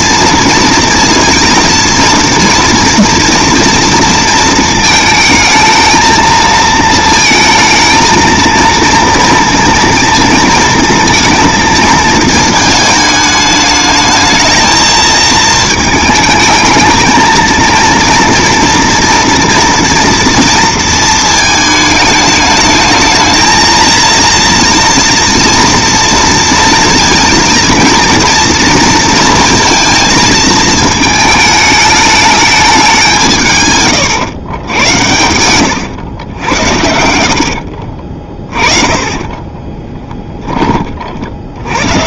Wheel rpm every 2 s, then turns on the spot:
230, 230, 230, 230, 230, 230, 220, 220, 220, 230, 230, 210, 230, 230, 230, 220, 200, 100, 80, 30, 20.
38-40